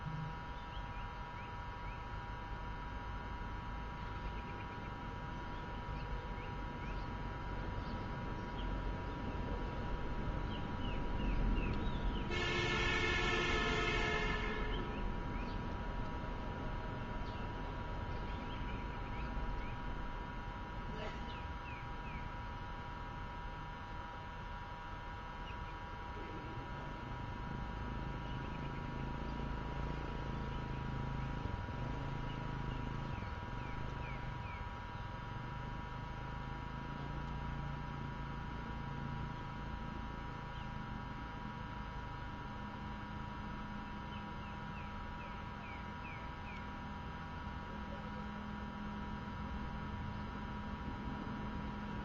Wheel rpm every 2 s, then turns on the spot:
0, 0, 0, 0, 0, 0, 0, 0, 0, 0, 0, 0, 0, 0, 0, 0, 0, 0, 0, 0, 0, 0, 0, 0, 0, 0.
none